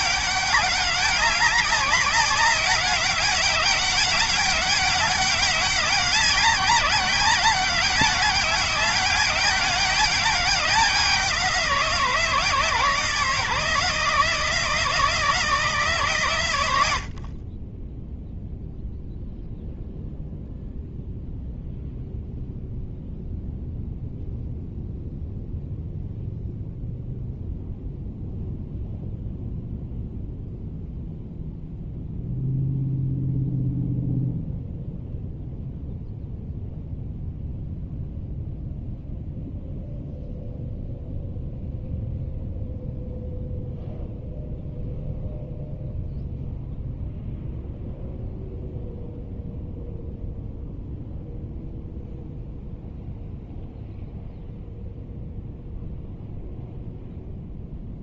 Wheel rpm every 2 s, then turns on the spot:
200, 200, 200, 190, 200, 190, 160, 160, 80, 0, 0, 0, 0, 0, 0, 0, 0, 0, 0, 0, 0, 0, 0, 0, 0, 0, 0, 0, 0.
none